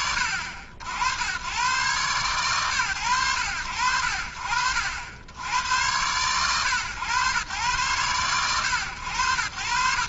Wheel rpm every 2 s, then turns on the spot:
80, 120, 60, 110, 110.
none